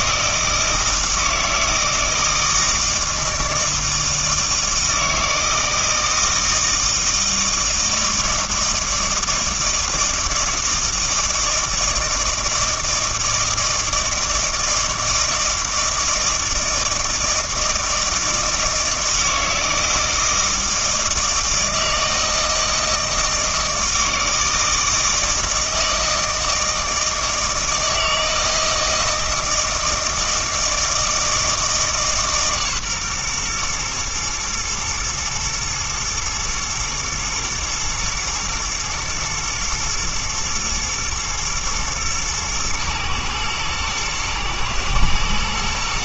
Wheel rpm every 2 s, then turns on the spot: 160, 160, 160, 160, 160, 160, 160, 160, 160, 160, 160, 160, 160, 160, 160, 160, 140, 110, 110, 110, 120, 110, 110.
none